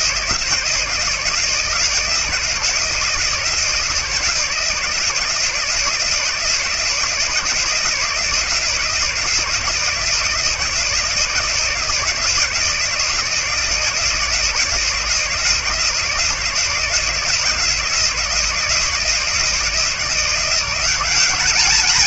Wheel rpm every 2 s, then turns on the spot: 170, 160, 160, 160, 160, 160, 160, 170, 160, 160, 180.
none